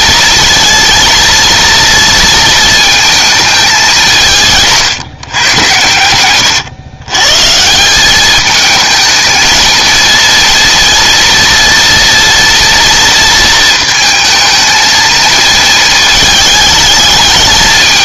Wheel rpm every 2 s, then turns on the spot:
230, 220, 150, 120, 220, 230, 230, 220, 220.
none